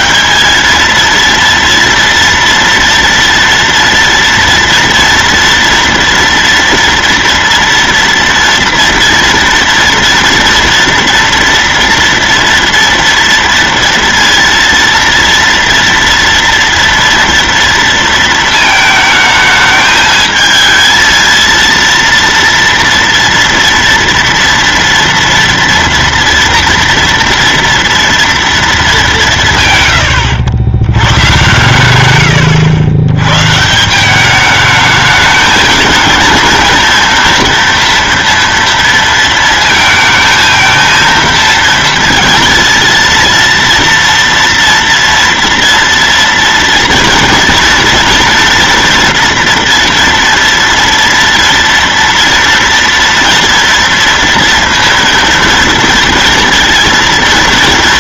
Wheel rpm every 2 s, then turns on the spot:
220, 230, 230, 230, 230, 240, 230, 230, 230, 220, 220, 230, 230, 230, 210, 100, 100, 210, 230, 230, 220, 230, 230, 230, 230, 230, 230, 230, 230.
none